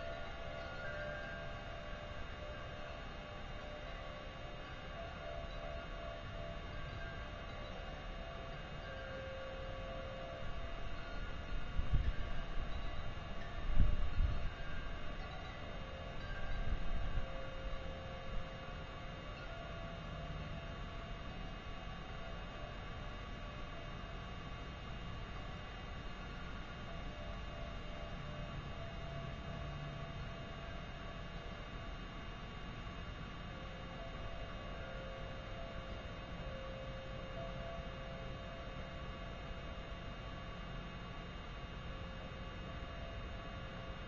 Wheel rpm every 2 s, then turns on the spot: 0, 0, 0, 0, 0, 0, 0, 0, 0, 0, 0, 0, 0, 0, 0, 0, 0, 0, 0, 0, 0, 0.
none